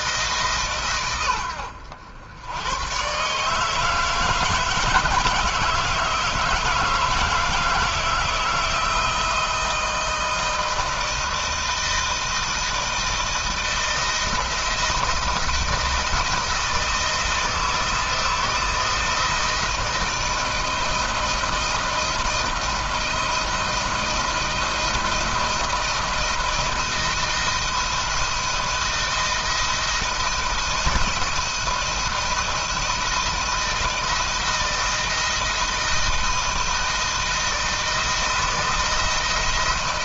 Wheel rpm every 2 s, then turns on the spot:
120, 130, 160, 160, 160, 160, 160, 170, 160, 160, 160, 160, 170, 170, 160, 160, 160, 160, 160, 160.
none